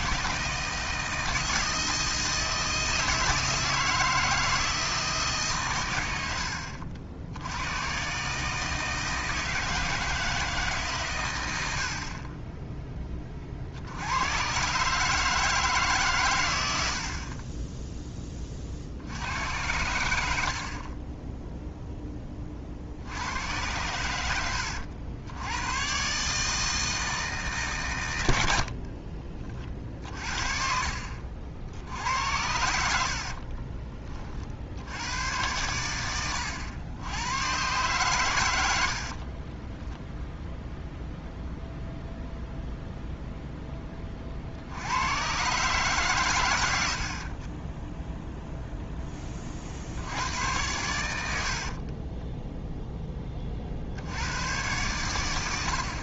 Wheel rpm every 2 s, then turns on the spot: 160, 160, 160, 70, 160, 150, 20, 130, 90, 40, 40, 40, 80, 160, 50, 50, 80, 70, 100, 90, 0, 0, 70, 80, 0, 100, 0, 120.
30-32 38-40